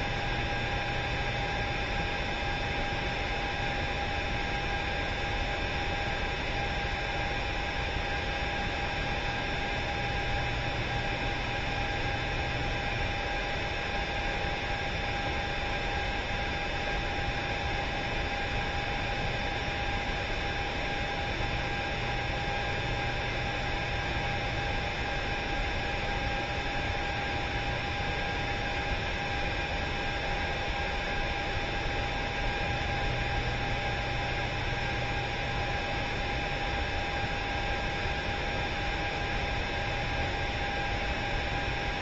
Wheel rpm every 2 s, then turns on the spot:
0, 0, 0, 0, 0, 0, 0, 0, 0, 0, 0, 0, 0, 0, 0, 0, 0, 0, 0, 0, 0.
none